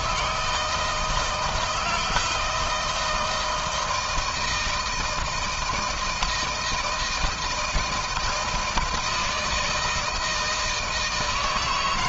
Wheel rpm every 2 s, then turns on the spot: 170, 170, 160, 160, 160, 160.
none